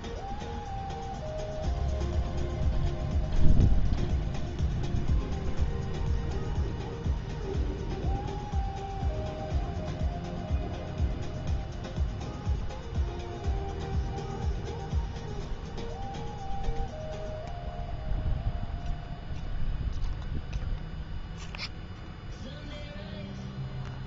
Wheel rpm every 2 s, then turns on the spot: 0, 0, 0, 0, 0, 0, 0, 0, 0, 0, 0, 0.
none